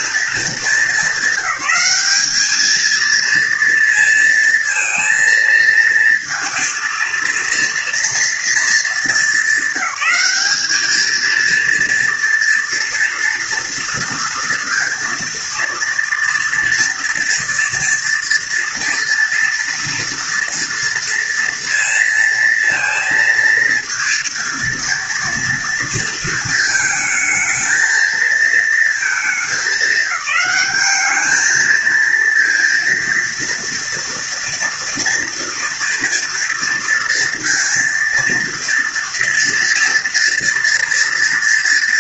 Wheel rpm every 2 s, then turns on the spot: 230, 210, 230, 230, 230, 200, 240, 230, 230, 230, 230, 230, 230, 220, 220, 210, 230, 230, 230, 230, 230.
none